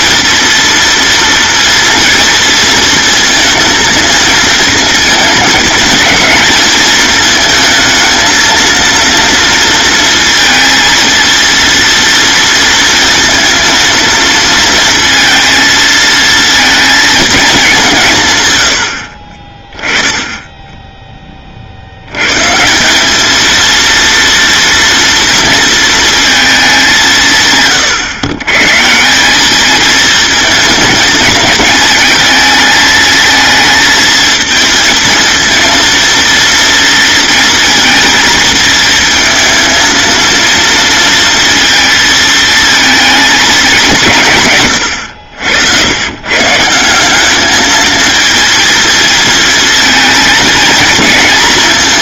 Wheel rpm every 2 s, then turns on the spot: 230, 230, 220, 220, 230, 230, 230, 230, 230, 80, 10, 190, 230, 190, 160, 230, 220, 230, 230, 220, 230, 220, 110, 180, 220, 230.
none